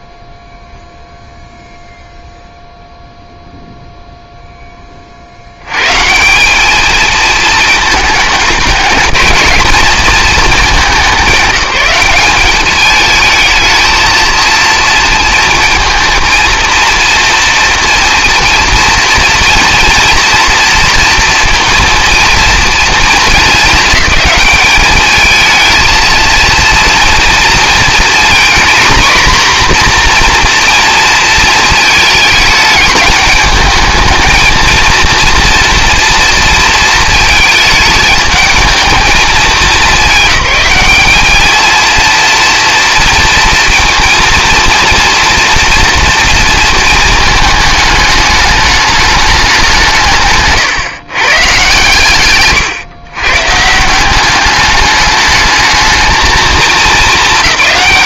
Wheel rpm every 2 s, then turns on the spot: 0, 0, 10, 200, 220, 200, 210, 230, 230, 230, 230, 230, 210, 230, 240, 240, 210, 220, 230, 210, 210, 230, 230, 230, 210, 140, 120, 200, 220.
none